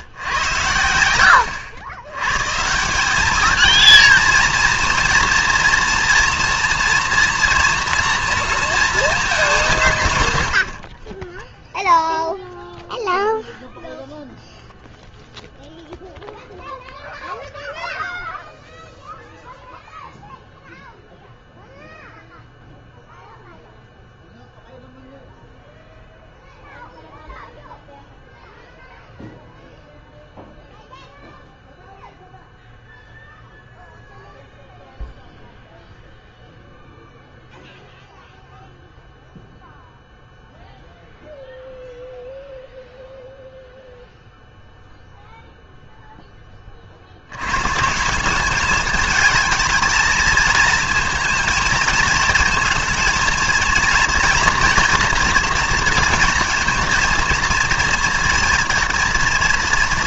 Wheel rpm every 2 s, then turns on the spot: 90, 150, 230, 230, 230, 70, 0, 0, 0, 0, 0, 0, 0, 0, 0, 0, 0, 0, 0, 0, 0, 0, 0, 20, 210, 220, 220, 230, 230, 230.
none